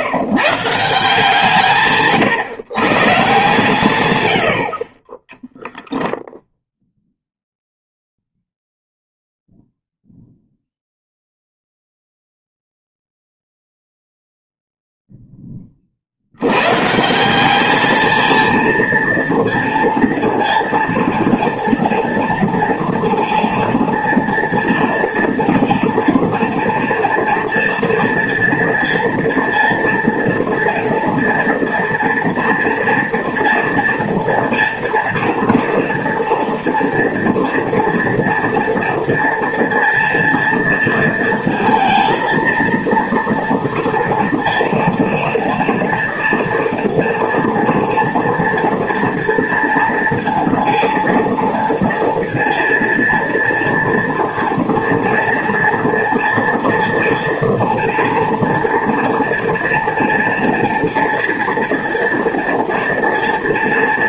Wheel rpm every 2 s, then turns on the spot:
150, 130, 70, 0, 0, 0, 0, 0, 110, 230, 230, 230, 230, 230, 230, 230, 230, 230, 230, 230, 230, 230, 230, 230, 230, 230, 230, 240, 230, 230, 230, 230.
none